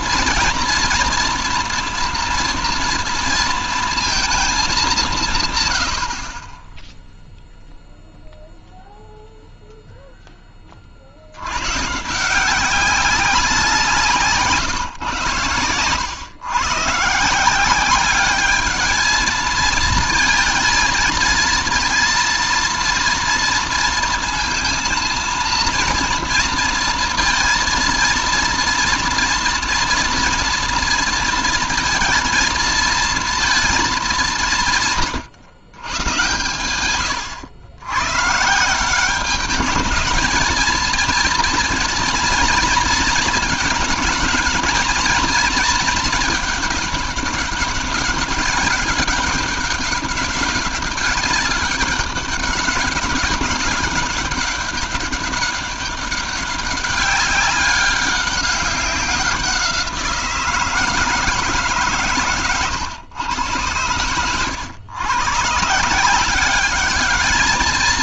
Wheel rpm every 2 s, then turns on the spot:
230, 240, 200, 20, 0, 30, 180, 140, 130, 210, 230, 230, 230, 230, 230, 230, 230, 170, 120, 150, 230, 230, 230, 210, 200, 200, 190, 200, 200, 190, 160, 130, 120, 200.
none